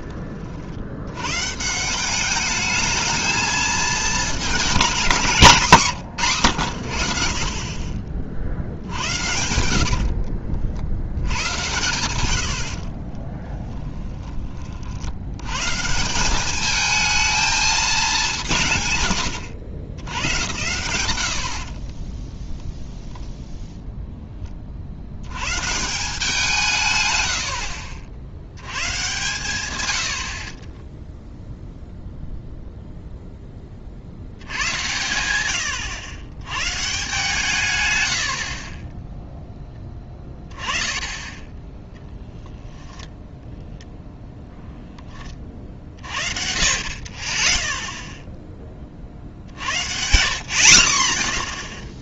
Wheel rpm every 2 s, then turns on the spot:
50, 210, 210, 100, 60, 60, 80, 30, 210, 160, 90, 0, 30, 160, 90, 20, 0, 90, 110, 40, 10, 10, 0, 50, 10, 50.
8-10 38-40